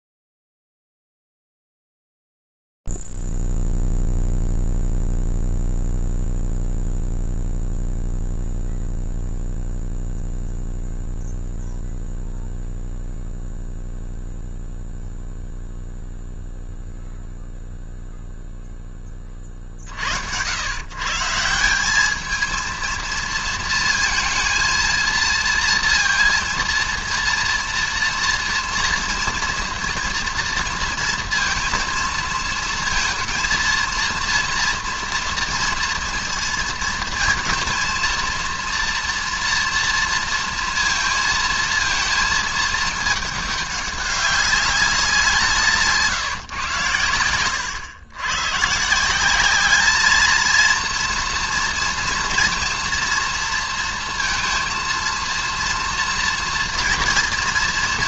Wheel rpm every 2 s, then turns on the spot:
0, 0, 0, 0, 0, 0, 0, 0, 0, 0, 110, 220, 230, 230, 230, 230, 230, 230, 230, 230, 230, 220, 200, 110, 130, 230, 230, 230, 230.
none